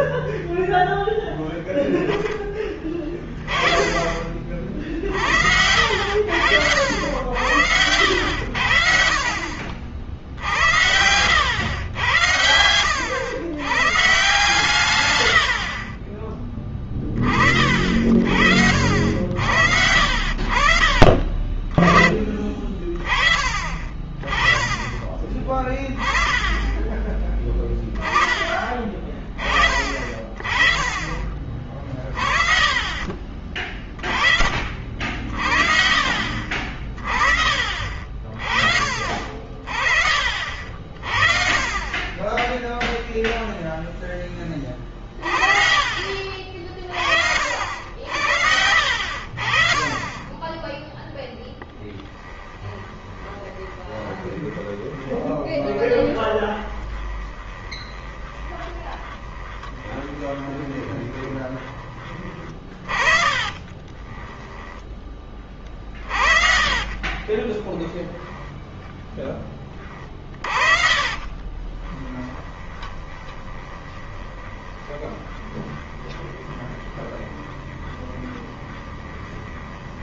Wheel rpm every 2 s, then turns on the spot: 10, 30, 40, 60, 70, 70, 90, 120, 20, 60, 60, 30, 30, 20, 30, 40, 40, 40, 50, 40, 40, 10, 20, 50, 90, 10, 20, 20, 20, 20, 20, 30, 10, 40, 10, 40, 20, 20, 20, 20.
52-62 64-68 70-80